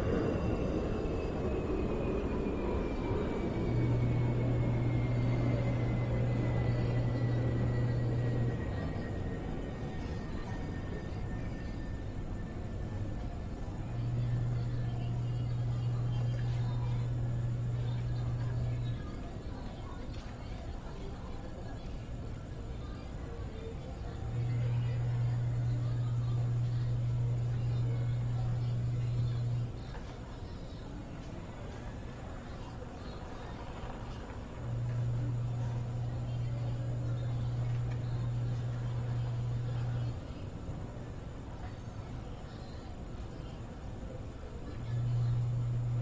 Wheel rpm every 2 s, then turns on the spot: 0, 0, 0, 0, 0, 0, 0, 0, 0, 0, 0, 0, 0, 0, 0, 0, 0, 0, 0, 0, 0, 0, 0.
none